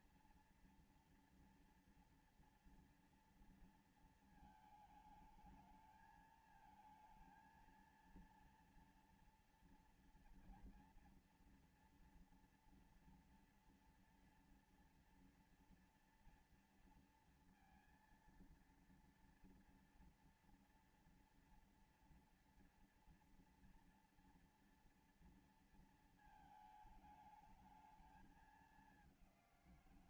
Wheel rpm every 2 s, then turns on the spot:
230, 230, 210, 220, 230, 230, 230, 230, 230, 230, 230, 230, 230, 210, 200.
none